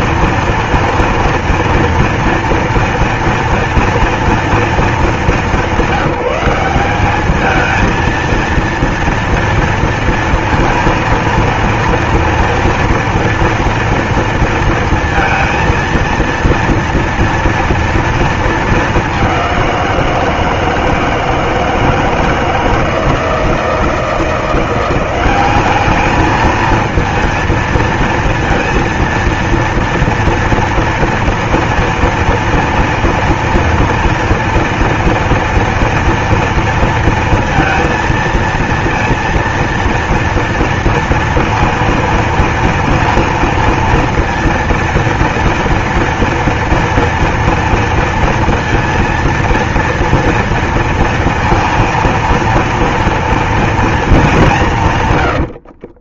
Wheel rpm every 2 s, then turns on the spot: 230, 230, 220, 190, 230, 230, 230, 230, 230, 220, 160, 160, 170, 220, 230, 230, 230, 230, 230, 230, 230, 230, 230, 230, 230, 230, 230, 190.
none